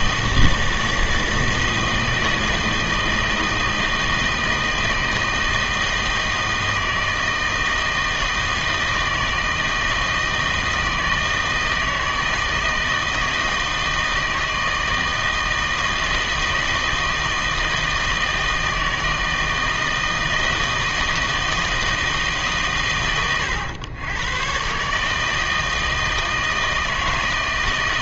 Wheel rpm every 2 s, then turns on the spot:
160, 160, 160, 160, 160, 160, 160, 160, 160, 160, 160, 140, 130, 160.
none